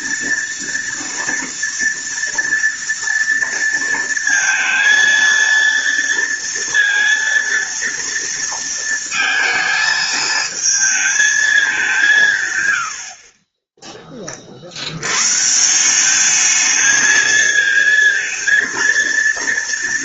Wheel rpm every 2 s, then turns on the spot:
230, 230, 230, 230, 230, 220, 90, 90, 220, 230.
none